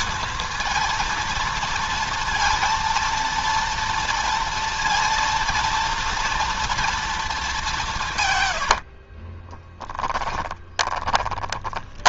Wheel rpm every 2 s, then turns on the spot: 230, 230, 230, 230, 110, 10.
8-12